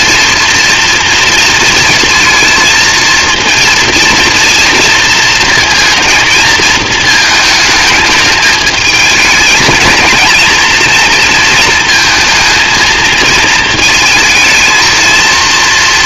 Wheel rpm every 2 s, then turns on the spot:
230, 230, 230, 220, 220, 230, 220, 230.
none